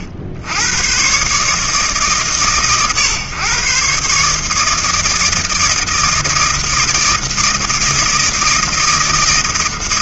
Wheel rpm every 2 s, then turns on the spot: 70, 120, 160, 160, 160.
none